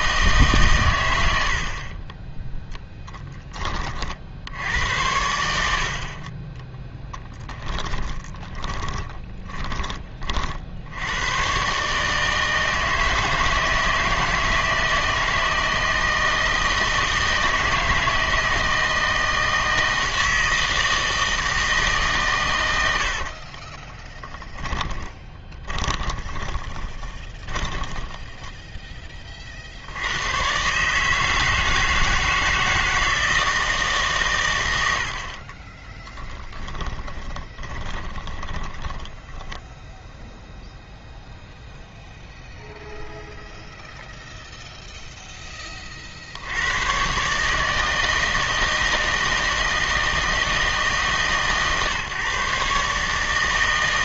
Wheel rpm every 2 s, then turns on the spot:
130, 10, 90, 10, 20, 60, 160, 160, 160, 160, 160, 100, 20, 30, 10, 140, 160, 100, 10, 20, 0, 0, 0, 110, 160, 160, 140.
6-10 24-28 36-40